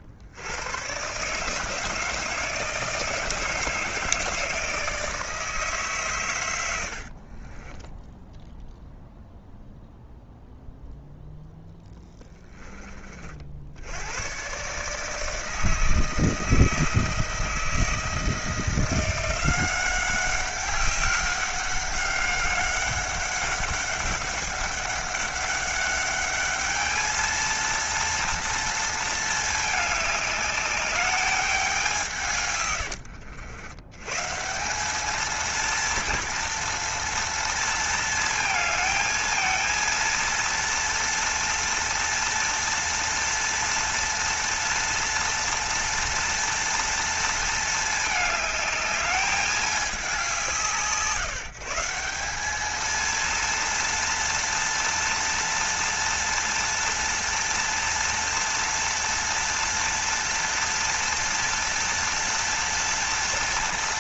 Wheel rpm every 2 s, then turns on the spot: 110, 160, 160, 80, 0, 0, 20, 130, 160, 170, 200, 200, 200, 210, 230, 210, 110, 190, 230, 220, 230, 230, 230, 230, 210, 160, 210, 230, 230, 240, 240, 230.
6-8 32-34